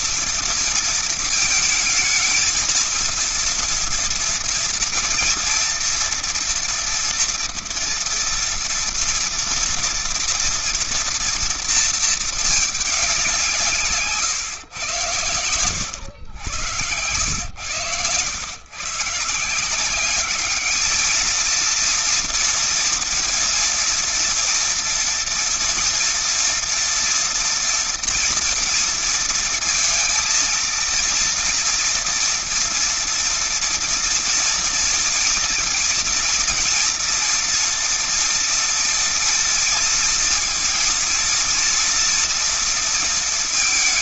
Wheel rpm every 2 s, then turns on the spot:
230, 230, 230, 240, 230, 230, 220, 130, 100, 110, 210, 230, 230, 240, 230, 230, 230, 230, 240, 230, 230, 230.
none